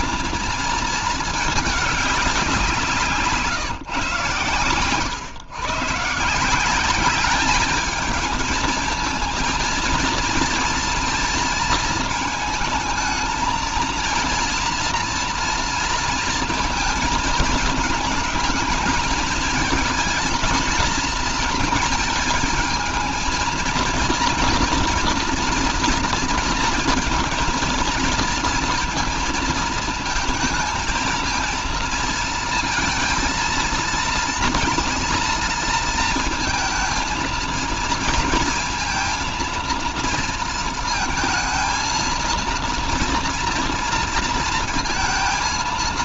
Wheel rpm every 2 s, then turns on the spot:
220, 180, 110, 190, 220, 230, 220, 230, 230, 220, 230, 220, 240, 230, 230, 230, 220, 230, 230, 230, 220, 230, 230.
none